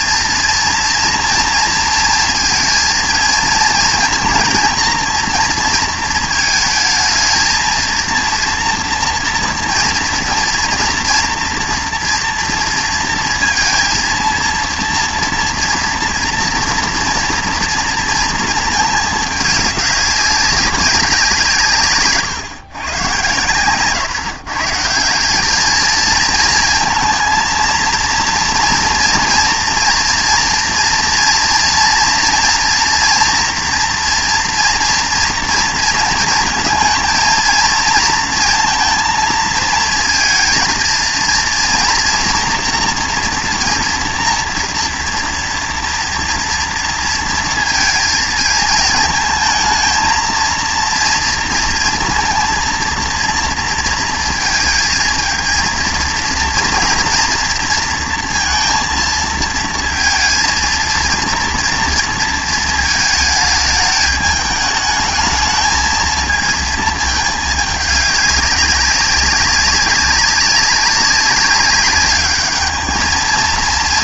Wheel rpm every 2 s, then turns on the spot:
230, 230, 240, 220, 240, 230, 230, 230, 230, 220, 200, 130, 150, 220, 230, 230, 230, 230, 230, 230, 230, 230, 230, 230, 220, 230, 230, 230, 230, 230, 230, 230, 210, 220, 200, 200, 210.
none